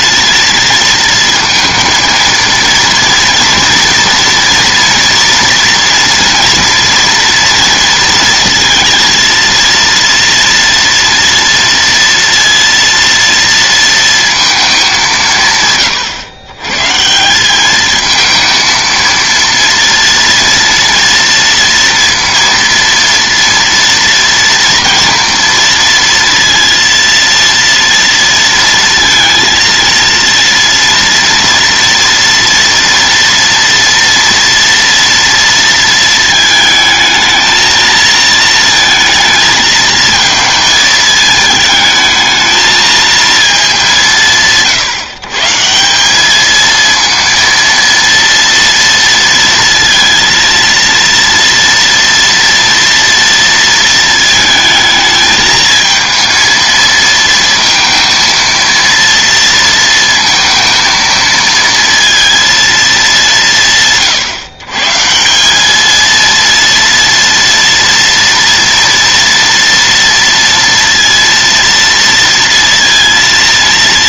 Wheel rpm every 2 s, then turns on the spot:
230, 230, 230, 230, 230, 240, 230, 220, 130, 230, 230, 230, 240, 230, 230, 230, 230, 230, 220, 230, 220, 220, 150, 220, 230, 230, 230, 220, 230, 230, 230, 230, 140, 230, 230, 230, 230.
none